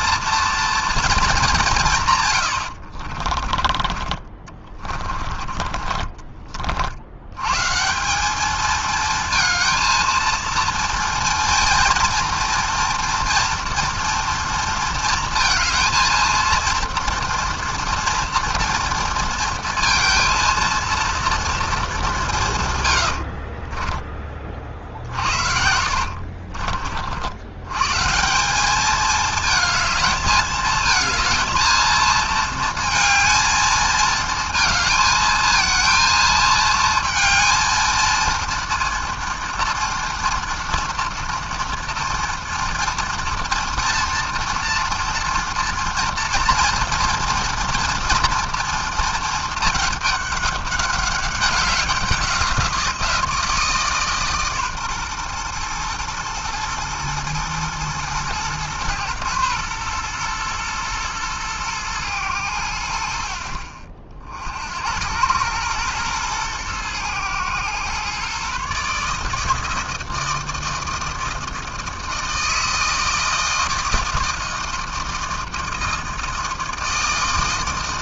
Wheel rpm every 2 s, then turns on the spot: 210, 30, 20, 110, 220, 230, 230, 230, 230, 230, 230, 70, 50, 80, 220, 220, 220, 220, 220, 230, 230, 230, 240, 230, 220, 200, 170, 120, 110, 110, 110, 60, 100, 110, 150, 160, 160, 160, 160.
2-6 22-26